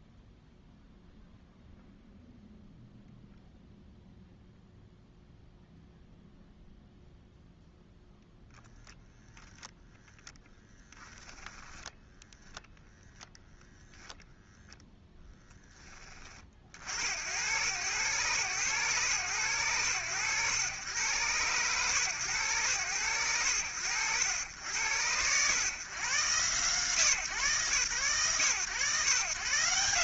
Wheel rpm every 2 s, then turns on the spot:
0, 0, 0, 0, 0, 10, 0, 0, 50, 120, 100, 120, 80, 130, 130.
10-12